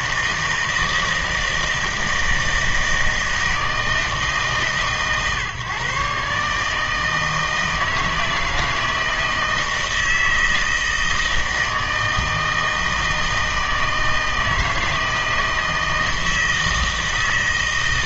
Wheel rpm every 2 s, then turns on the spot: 160, 160, 140, 150, 160, 160, 160, 160, 160.
none